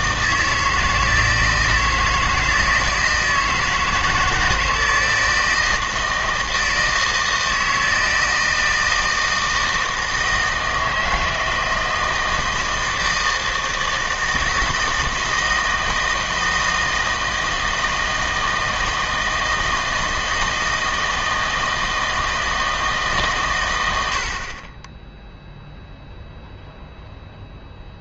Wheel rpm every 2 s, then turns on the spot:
160, 160, 160, 160, 160, 160, 160, 160, 160, 160, 160, 160, 30, 0.
none